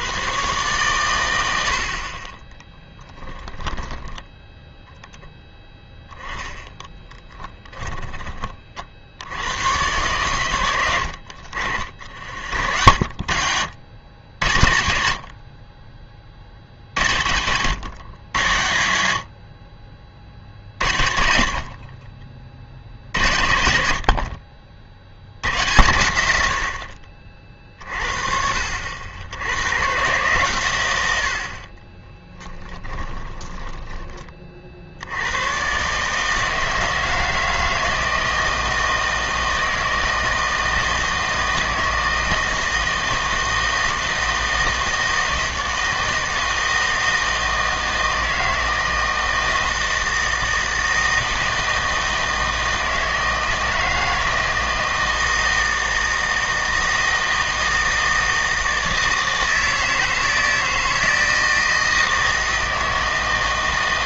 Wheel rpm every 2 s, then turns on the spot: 120, 10, 10, 10, 40, 100, 50, 80, 60, 90, 70, 60, 50, 60, 60, 120, 10, 50, 160, 160, 160, 160, 160, 160, 160, 160, 160, 160, 160, 160, 160, 160.
2-4 32-34